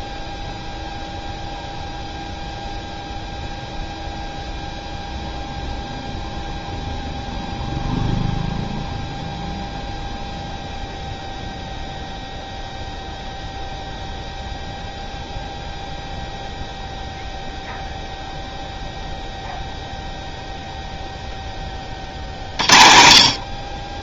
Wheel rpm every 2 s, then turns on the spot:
0, 0, 0, 0, 0, 0, 0, 0, 0, 0, 0, 50.
none